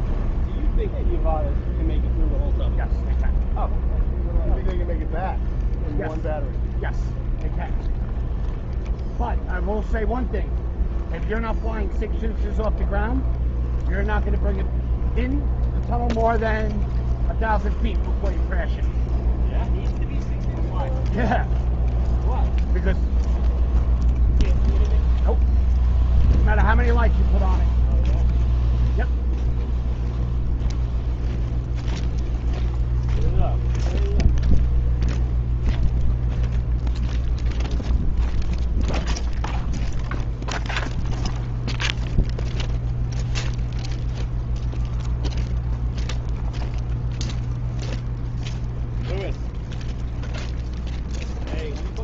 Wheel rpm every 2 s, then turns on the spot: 0, 0, 0, 0, 0, 0, 0, 0, 0, 0, 0, 0, 0, 0, 0, 0, 0, 0, 0, 0, 0, 0, 0, 0, 0, 0.
none